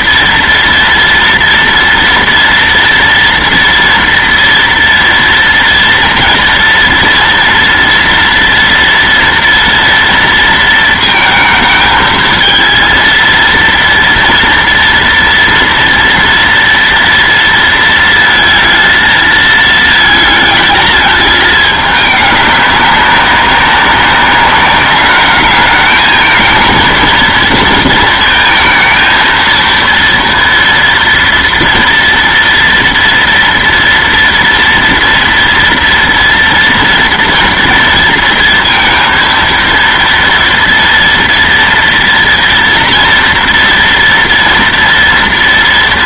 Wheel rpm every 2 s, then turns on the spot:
240, 240, 230, 240, 230, 230, 230, 230, 230, 230, 220, 200, 210, 230, 230, 230, 240, 230, 230, 230, 230, 230, 240.
none